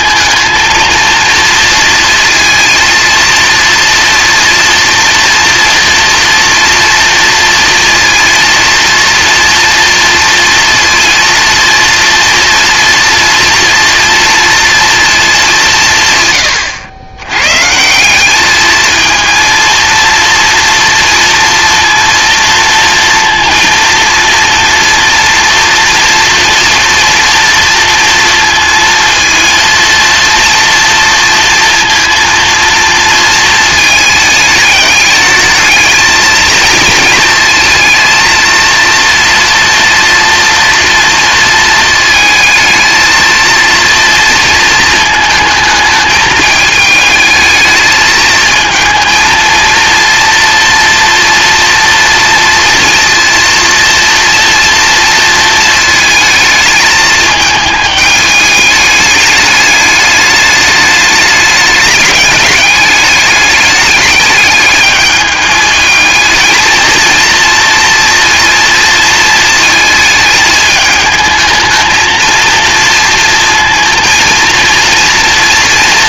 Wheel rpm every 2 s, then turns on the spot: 230, 230, 230, 230, 230, 240, 240, 240, 90, 220, 230, 230, 230, 230, 230, 240, 230, 210, 230, 230, 230, 220, 220, 220, 220, 230, 230, 230, 220, 210, 210, 210, 210, 220, 230, 220, 230, 230.
none